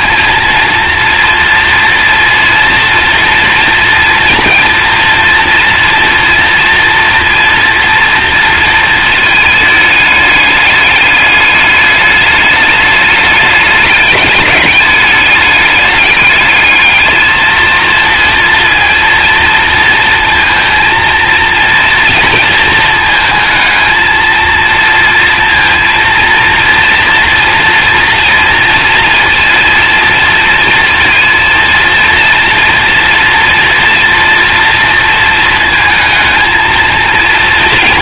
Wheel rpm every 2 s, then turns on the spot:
230, 230, 230, 230, 230, 210, 210, 210, 210, 230, 230, 220, 230, 230, 230, 230, 230, 230, 230.
none